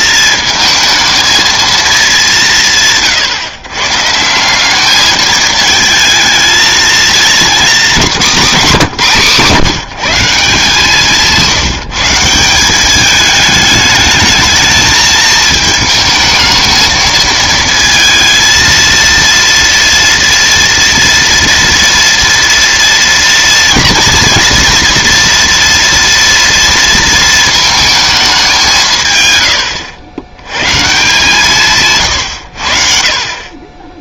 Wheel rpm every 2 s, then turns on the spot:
220, 160, 190, 220, 190, 170, 190, 220, 220, 230, 230, 230, 240, 230, 190, 120, 80.
none